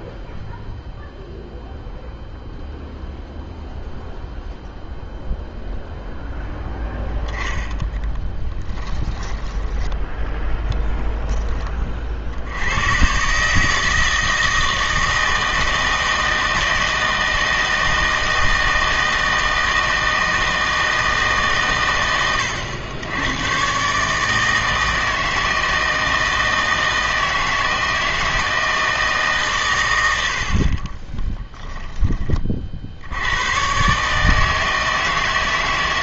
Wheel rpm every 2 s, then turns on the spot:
0, 0, 0, 0, 20, 10, 100, 160, 160, 160, 160, 90, 160, 160, 160, 50, 60, 160.
8-10 30-32